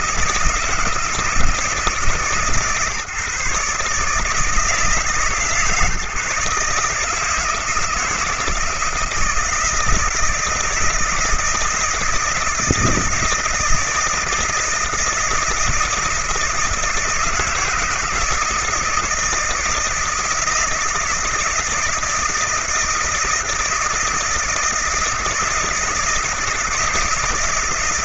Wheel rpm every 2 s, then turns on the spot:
160, 140, 160, 150, 160, 160, 170, 160, 160, 160, 160, 160, 160, 160.
none